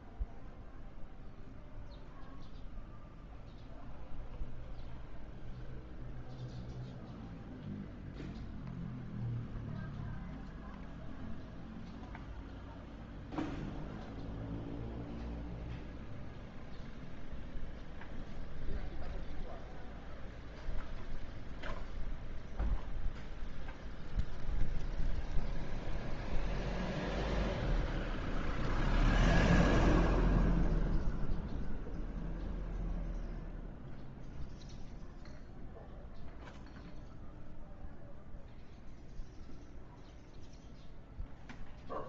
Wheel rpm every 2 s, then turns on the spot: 0, 0, 0, 0, 0, 0, 0, 0, 0, 0, 0, 0, 0, 0, 0, 0, 0, 0, 0, 0, 0.
none